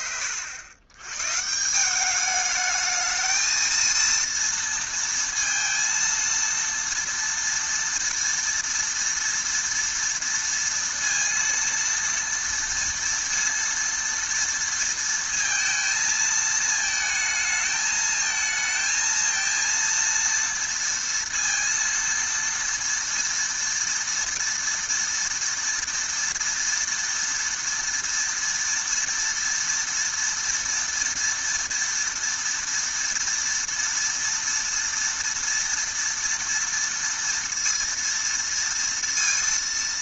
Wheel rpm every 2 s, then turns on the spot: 110, 220, 230, 230, 230, 230, 230, 230, 220, 220, 230, 230, 230, 230, 230, 230, 230, 230, 230, 230.
none